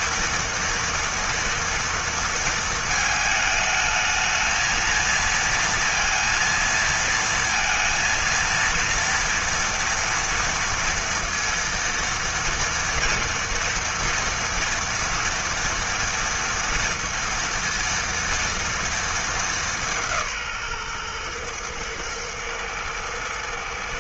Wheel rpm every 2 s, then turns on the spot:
230, 220, 230, 230, 230, 230, 230, 230, 230, 220, 120, 110.
none